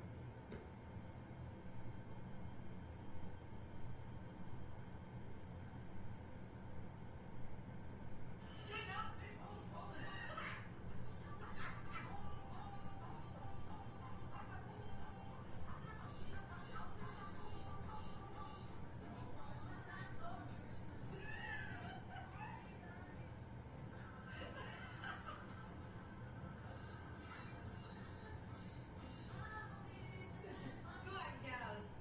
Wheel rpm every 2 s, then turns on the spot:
0, 0, 0, 0, 0, 0, 0, 0, 0, 0, 0, 0, 0, 0, 0, 0.
none